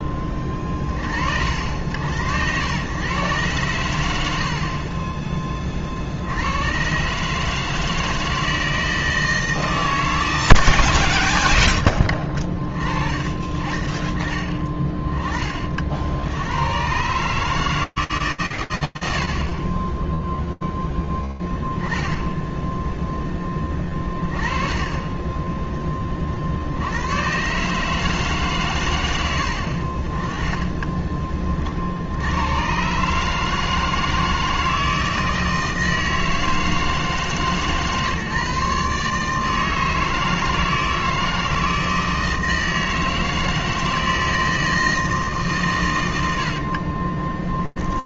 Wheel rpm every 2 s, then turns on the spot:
30, 100, 70, 90, 160, 100, 40, 20, 90, 130, 0, 0, 30, 90, 110, 30, 150, 160, 160, 150, 160, 160, 140, 30.
4-6 10-12 46-48